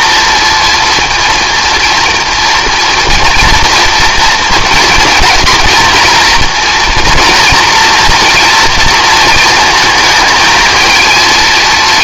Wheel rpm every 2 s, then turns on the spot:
230, 230, 230, 230, 240, 220.
none